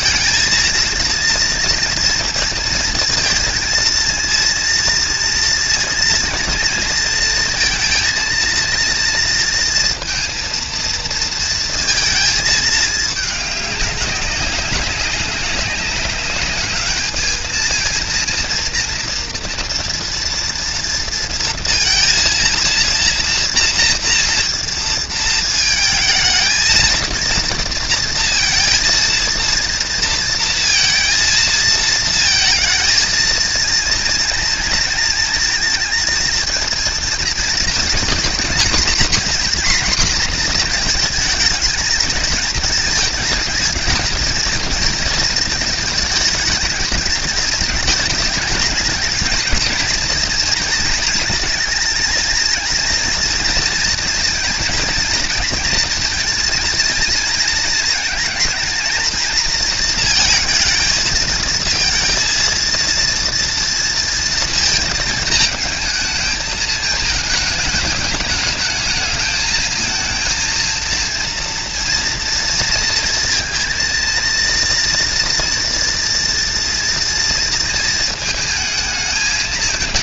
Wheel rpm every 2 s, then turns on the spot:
230, 220, 230, 230, 230, 230, 220, 200, 210, 230, 230, 230, 230, 230, 230, 230, 230, 230, 220, 230, 230, 220, 230, 220, 210, 230, 230, 230, 230, 220, 220, 230, 230, 220, 210, 230, 230, 230, 230, 220.
none